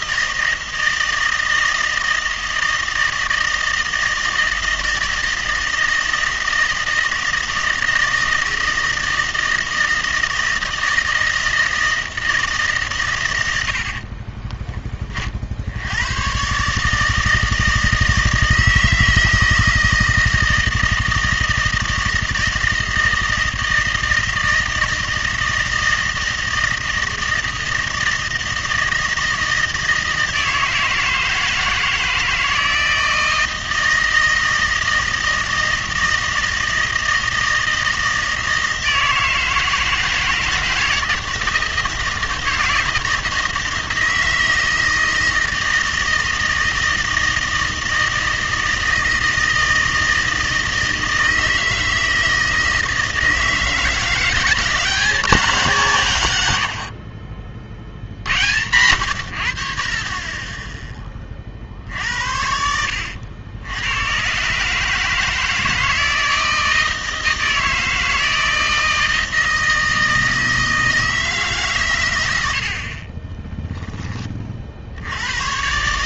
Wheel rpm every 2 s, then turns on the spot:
160, 160, 160, 160, 160, 160, 140, 20, 140, 160, 160, 160, 160, 160, 160, 160, 160, 160, 160, 160, 160, 160, 160, 160, 160, 160, 160, 190, 70, 90, 10, 70, 140, 160, 160, 160, 80, 50.
none